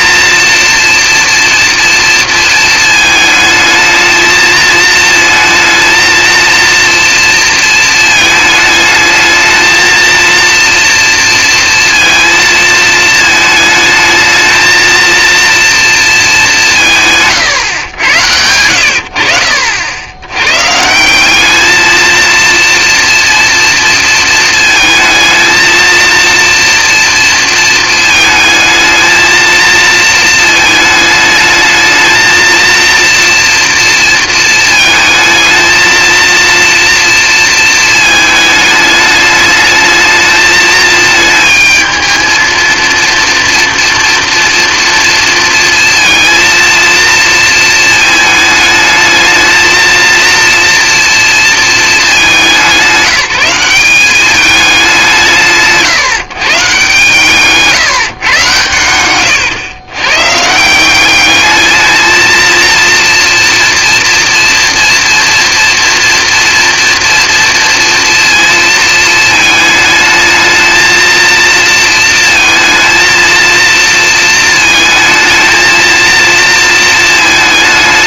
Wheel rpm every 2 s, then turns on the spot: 230, 220, 220, 230, 220, 230, 230, 220, 190, 90, 140, 230, 220, 230, 220, 220, 230, 220, 230, 210, 220, 230, 230, 230, 220, 240, 190, 200, 150, 120, 170, 230, 240, 230, 230, 220, 230, 220, 230.
58-60